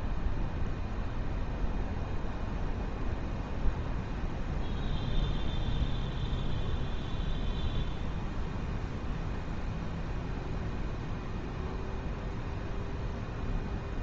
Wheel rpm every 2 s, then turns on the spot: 0, 0, 0, 0, 0, 0, 0.
none